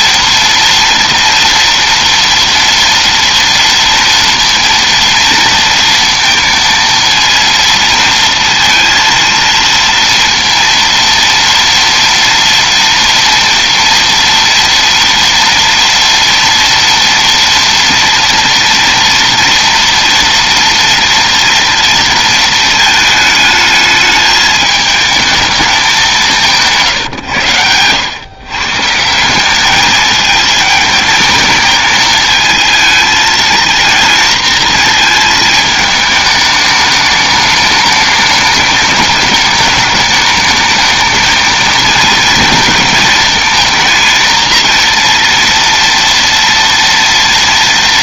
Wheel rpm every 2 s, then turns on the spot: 230, 230, 230, 230, 230, 230, 230, 240, 230, 230, 230, 220, 220, 150, 140, 220, 220, 230, 210, 210, 220, 230, 230, 230.
none